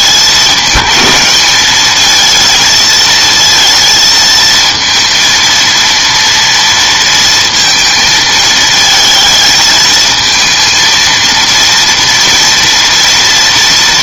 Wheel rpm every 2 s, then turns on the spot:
210, 220, 230, 230, 220, 230, 230.
none